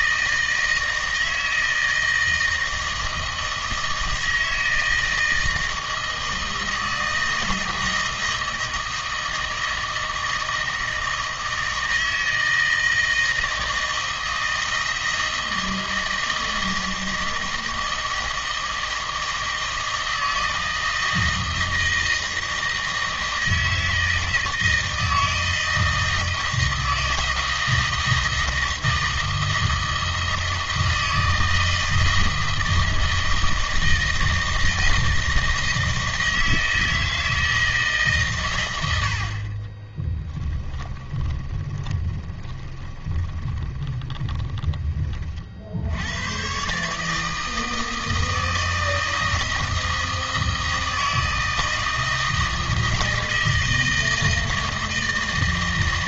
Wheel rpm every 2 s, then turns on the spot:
160, 160, 160, 160, 160, 160, 160, 160, 160, 160, 160, 160, 160, 160, 160, 160, 160, 160, 160, 110, 20, 20, 20, 130, 160, 160, 160, 160.
40-46